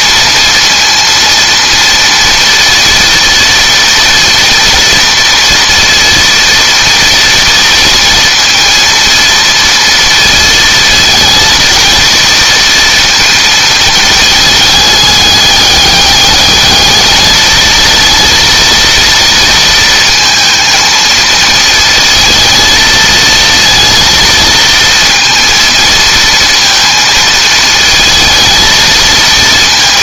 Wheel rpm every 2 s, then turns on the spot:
230, 230, 230, 230, 230, 230, 230, 210, 210, 230, 230, 220, 230, 230, 230.
none